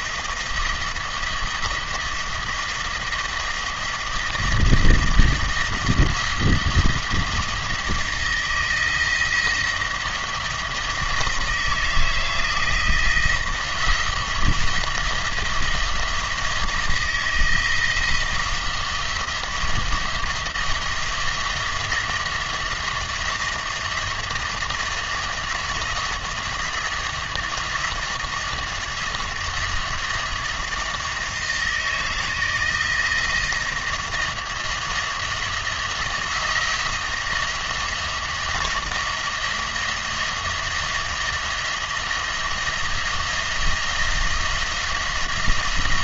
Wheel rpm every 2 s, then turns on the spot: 170, 170, 170, 170, 170, 170, 170, 170, 160, 170, 170, 160, 170, 170, 170, 160, 160, 170, 170, 170, 170, 170, 170.
none